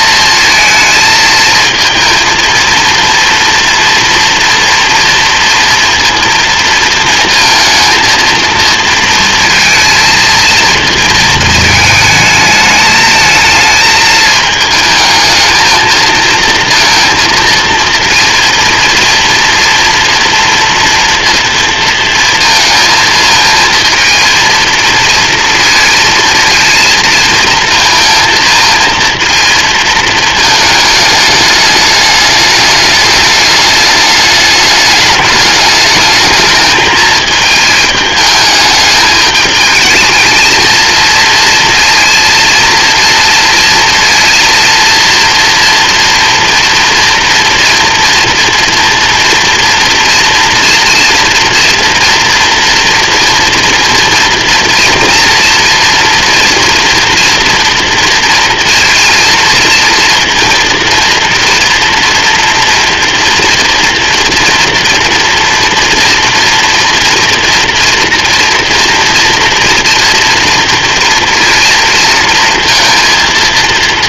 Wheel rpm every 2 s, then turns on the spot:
220, 230, 230, 230, 230, 230, 220, 220, 230, 230, 230, 220, 230, 230, 230, 210, 210, 210, 220, 210, 230, 230, 230, 230, 230, 230, 230, 230, 230, 230, 230, 240, 240, 230, 230, 240, 230.
none